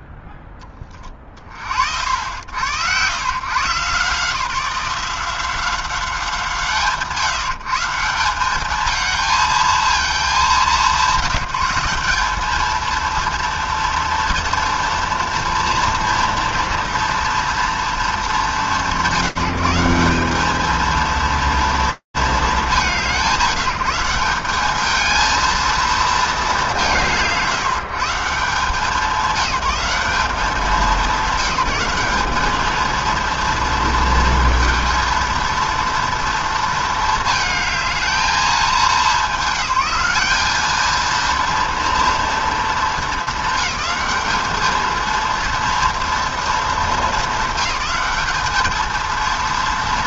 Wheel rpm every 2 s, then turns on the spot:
10, 70, 140, 180, 150, 220, 190, 230, 230, 230, 190, 220, 180, 230, 140, 190, 200, 230, 230, 220, 200, 230, 220, 230, 220.
none